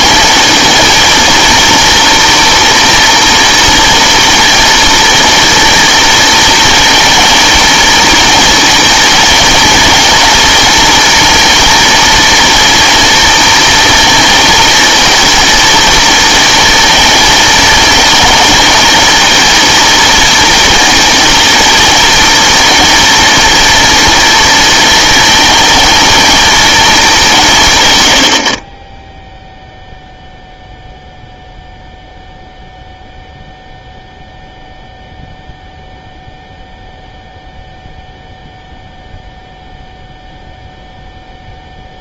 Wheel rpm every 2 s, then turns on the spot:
230, 230, 240, 230, 230, 230, 230, 220, 230, 220, 230, 230, 230, 230, 50, 0, 0, 0, 0, 0, 0.
none